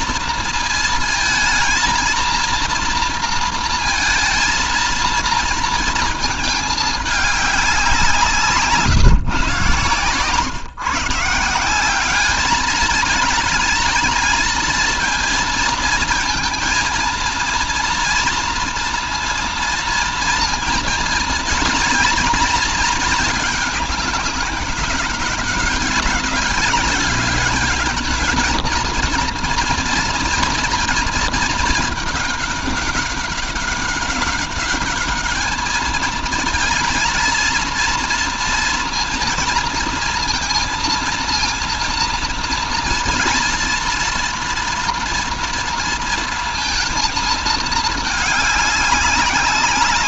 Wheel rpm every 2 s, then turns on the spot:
230, 230, 230, 210, 150, 150, 210, 230, 230, 230, 230, 230, 200, 200, 230, 230, 200, 210, 230, 230, 230, 230, 230, 230, 200.
none